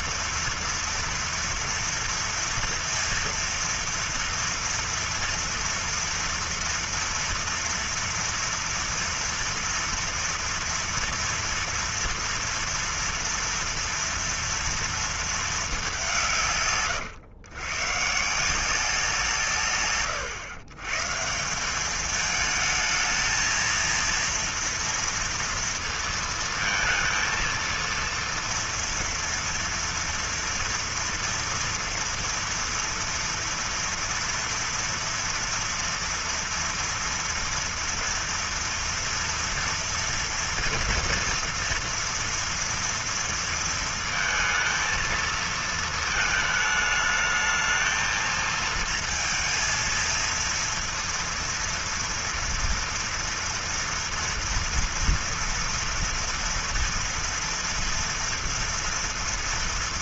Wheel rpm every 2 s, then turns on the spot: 230, 230, 230, 230, 230, 230, 230, 230, 160, 160, 120, 220, 230, 230, 230, 230, 230, 230, 240, 230, 230, 230, 230, 220, 230, 230, 230, 230, 230, 230.
none